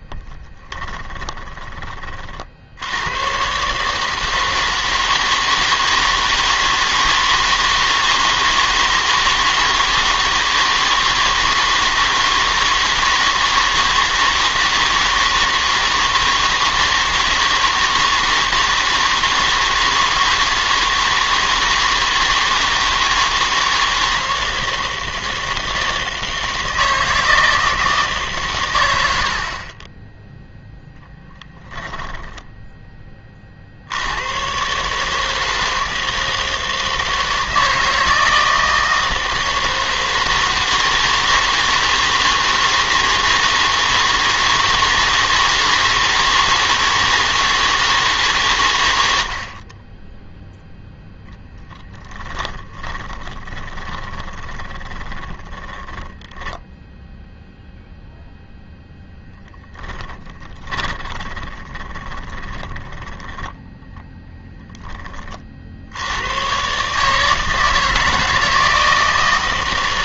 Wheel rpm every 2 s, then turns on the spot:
10, 70, 160, 160, 160, 160, 160, 160, 160, 160, 160, 160, 160, 160, 120, 0, 10, 130, 160, 160, 160, 160, 160, 160, 120, 0, 20, 20, 10, 0, 30, 10, 20, 130, 160.
0-2 52-58 60-64